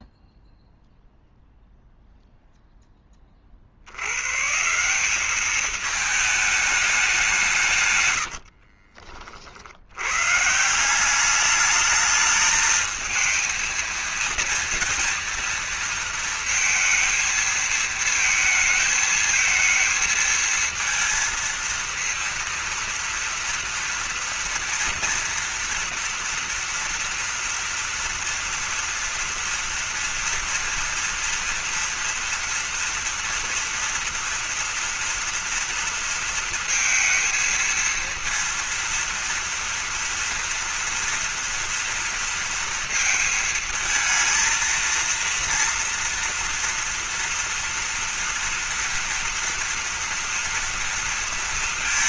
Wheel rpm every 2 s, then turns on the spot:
0, 0, 170, 210, 60, 160, 220, 230, 230, 220, 230, 230, 240, 230, 230, 240, 230, 230, 230, 230, 230, 230, 230, 240, 230, 230.
8-10